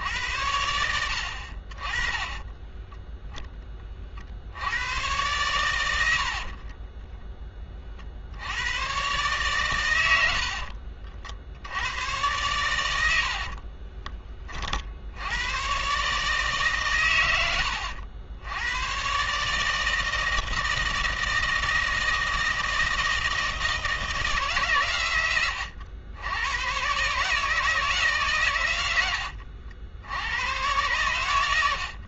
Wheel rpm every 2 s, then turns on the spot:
70, 10, 90, 30, 100, 60, 100, 50, 140, 100, 160, 160, 140, 120, 110, 110.
6-8 10-12